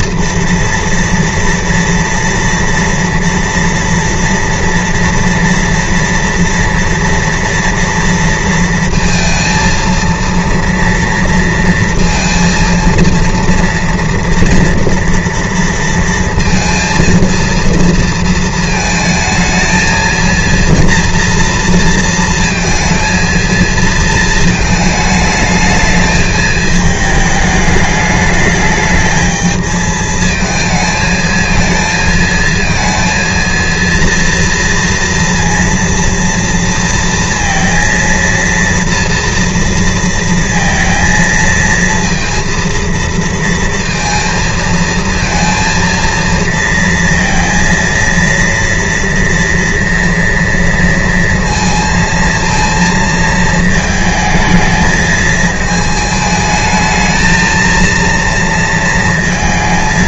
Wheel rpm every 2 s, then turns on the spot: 230, 230, 230, 230, 230, 230, 230, 240, 230, 230, 230, 230, 220, 220, 220, 220, 230, 230, 230, 230, 230, 230, 230, 230, 230, 230, 230, 220, 220, 220.
none